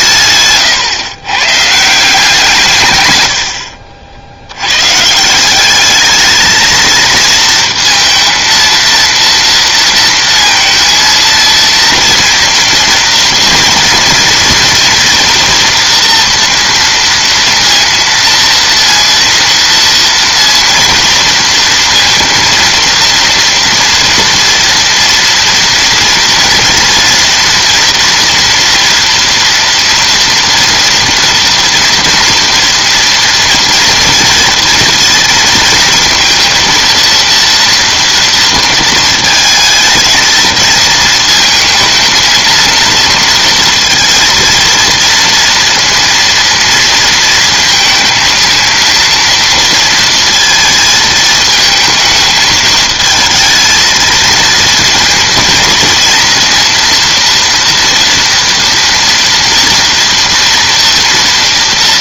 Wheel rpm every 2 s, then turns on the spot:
130, 150, 110, 220, 230, 230, 230, 230, 230, 230, 230, 230, 230, 230, 230, 230, 230, 230, 230, 230, 220, 230, 230, 230, 230, 220, 220, 230, 230, 230, 230.
0-2